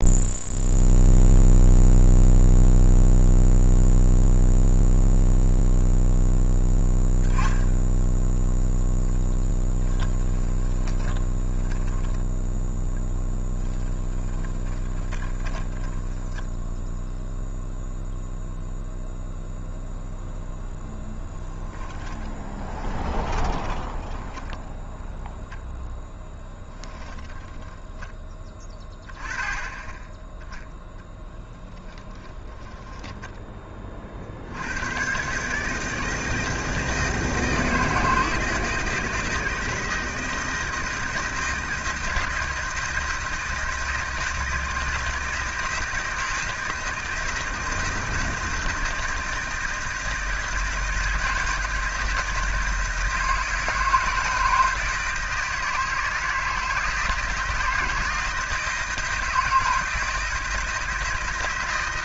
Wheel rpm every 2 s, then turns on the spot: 0, 0, 0, 10, 0, 20, 10, 20, 10, 0, 0, 20, 10, 10, 10, 10, 10, 80, 160, 160, 160, 160, 160, 160, 160, 160, 160, 160, 160, 170, 160.
10-12 14-16 22-28 32-34